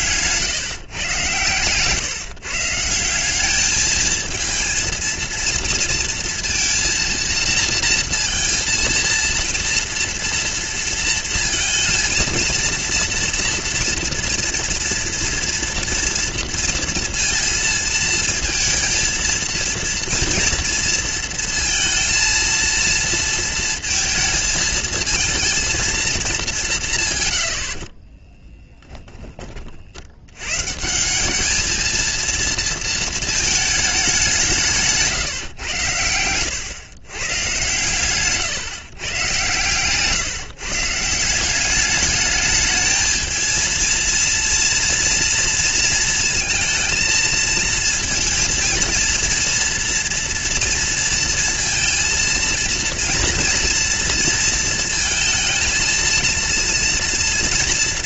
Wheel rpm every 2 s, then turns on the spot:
140, 150, 230, 230, 230, 230, 230, 230, 230, 220, 230, 230, 230, 190, 20, 120, 230, 170, 110, 130, 150, 210, 230, 230, 230, 230, 230, 230, 230.
28-30